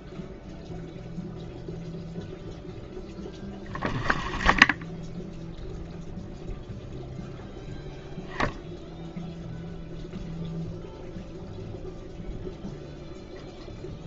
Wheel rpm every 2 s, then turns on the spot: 0, 0, 10, 0, 0, 0, 0.
none